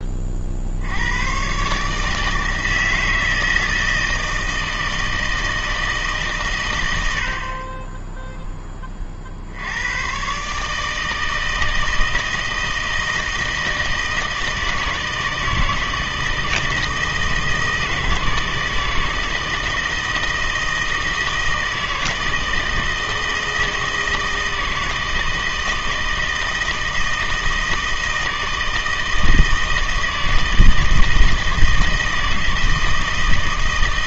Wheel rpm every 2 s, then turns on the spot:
60, 160, 160, 120, 10, 150, 160, 160, 160, 160, 160, 160, 160, 160, 160, 160, 160.
none